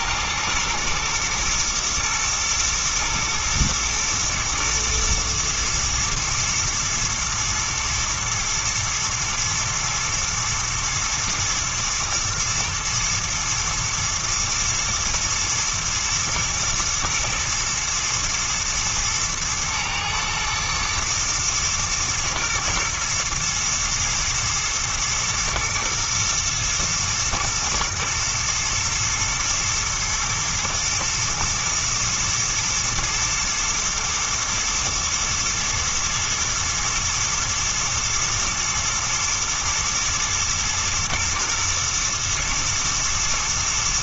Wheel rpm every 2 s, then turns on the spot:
110, 110, 110, 120, 110, 110, 120, 110, 110, 120, 110, 120, 120, 110, 110, 110, 110, 110, 110, 120, 110, 120.
none